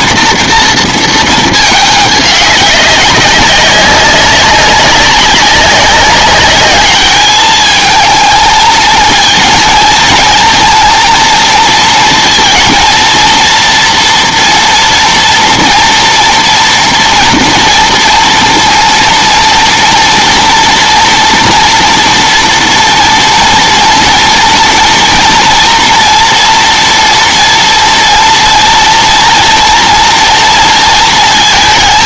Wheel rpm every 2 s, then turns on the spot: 230, 200, 190, 210, 230, 230, 230, 230, 240, 230, 230, 240, 230, 230, 230, 230.
none